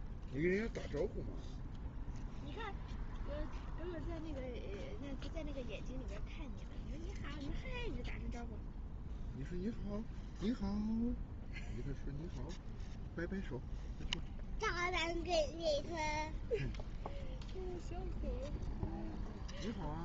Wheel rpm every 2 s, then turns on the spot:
0, 0, 0, 0, 0, 0, 0, 0, 0, 0.
none